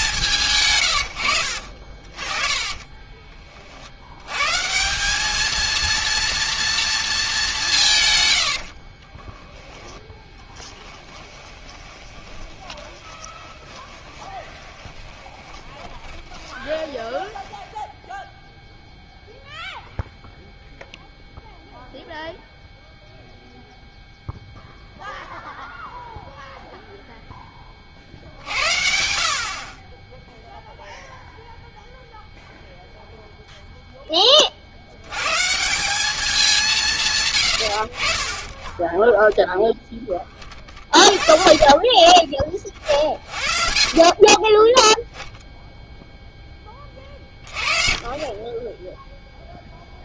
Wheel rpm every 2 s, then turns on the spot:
140, 40, 140, 230, 80, 20, 20, 20, 20, 0, 0, 0, 0, 0, 70, 0, 0, 50, 180, 10, 30, 30, 20, 20, 20.
2-4 8-18